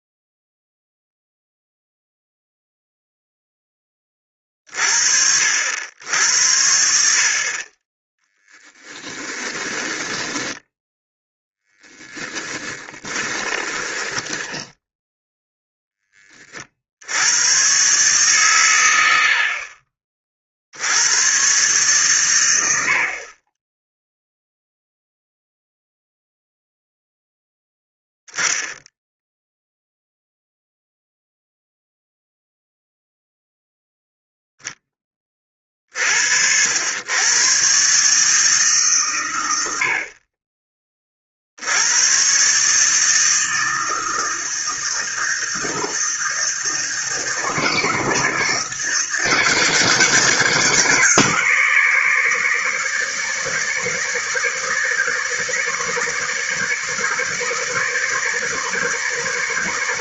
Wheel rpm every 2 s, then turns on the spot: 0, 0, 40, 70, 10, 10, 10, 10, 60, 100, 70, 70, 0, 0, 0, 0, 0, 10, 90, 140, 30, 150, 160, 160, 150, 140, 150, 150, 150, 140.
8-16